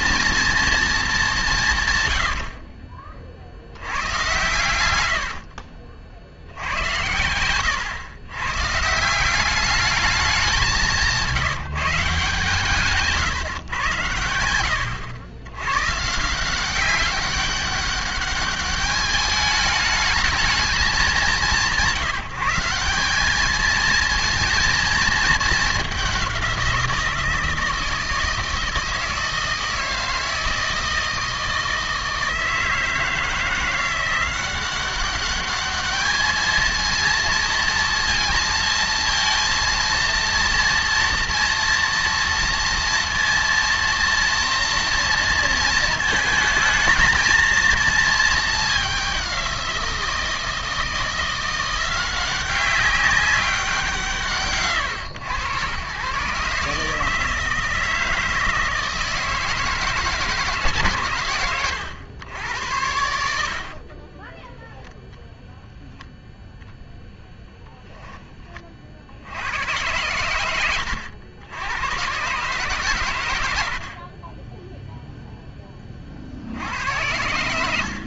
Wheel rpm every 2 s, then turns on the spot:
230, 60, 100, 90, 130, 200, 150, 100, 180, 200, 220, 180, 230, 180, 160, 160, 160, 180, 220, 230, 230, 230, 230, 220, 210, 170, 190, 130, 150, 160, 150, 90, 10, 0, 20, 100, 140, 10, 70.
2-6 74-76